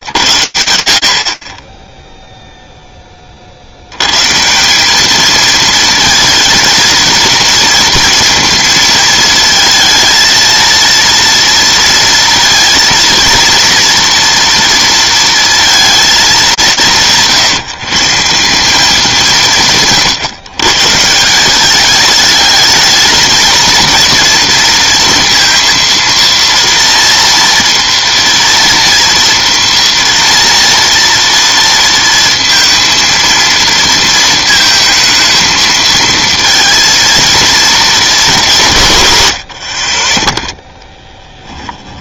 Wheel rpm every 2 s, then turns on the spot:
70, 10, 190, 230, 220, 230, 230, 230, 160, 190, 150, 220, 230, 230, 230, 230, 230, 230, 220, 140, 10.
40-42